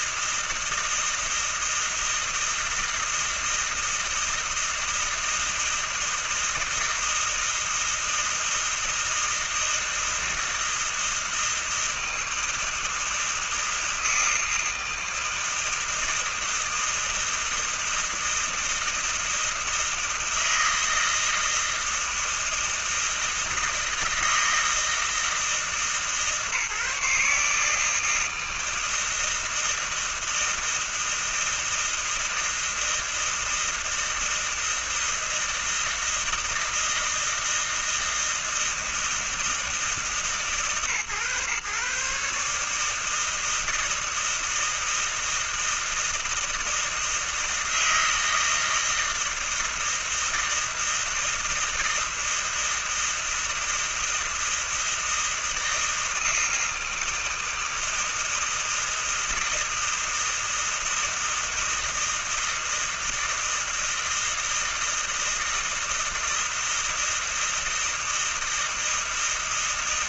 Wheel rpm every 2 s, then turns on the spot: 160, 160, 160, 160, 160, 160, 160, 160, 160, 160, 160, 160, 160, 150, 160, 160, 160, 160, 160, 160, 130, 150, 160, 160, 160, 160, 160, 160, 160, 160, 160, 160, 160, 160, 160.
none